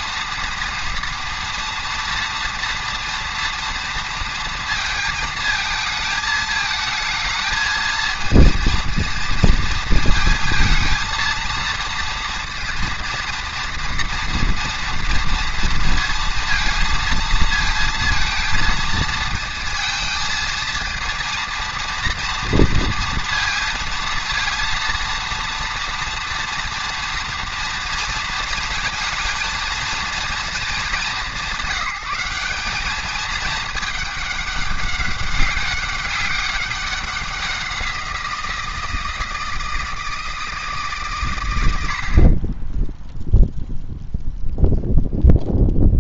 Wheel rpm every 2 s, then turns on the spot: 230, 230, 230, 220, 230, 220, 230, 230, 230, 230, 230, 230, 230, 230, 230, 220, 200, 200, 200, 170, 160, 20, 0.
none